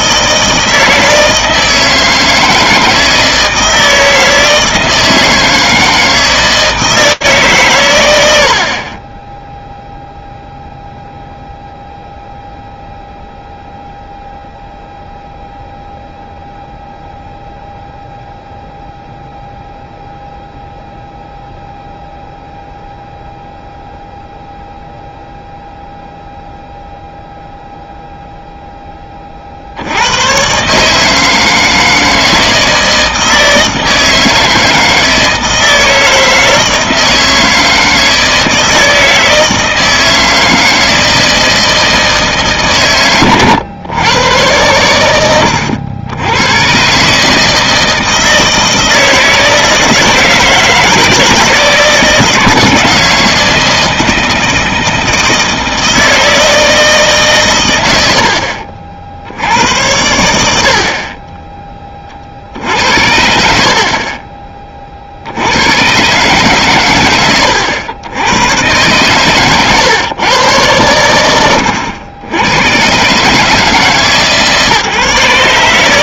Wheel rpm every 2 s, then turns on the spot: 160, 160, 160, 160, 40, 0, 0, 0, 0, 0, 0, 0, 0, 0, 10, 140, 160, 160, 160, 160, 160, 130, 100, 120, 160, 160, 160, 160, 160, 60, 60, 70, 20, 120, 120, 120, 110, 150.
none